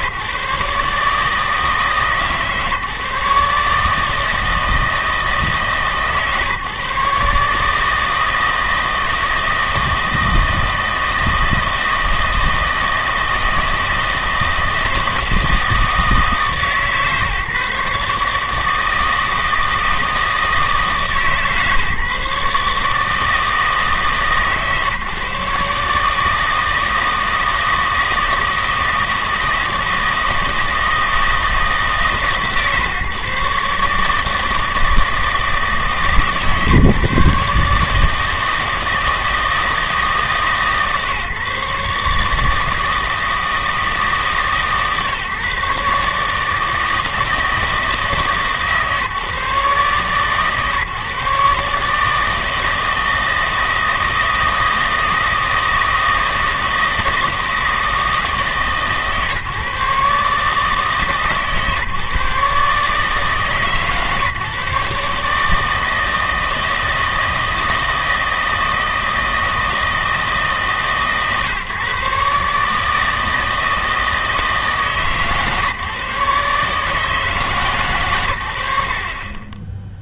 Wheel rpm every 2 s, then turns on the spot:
150, 150, 160, 150, 160, 160, 160, 160, 150, 150, 160, 150, 150, 160, 160, 160, 140, 160, 150, 160, 140, 160, 150, 160, 150, 140, 160, 160, 160, 150, 150, 140, 140, 160, 160, 150, 150, 150, 150, 80.
none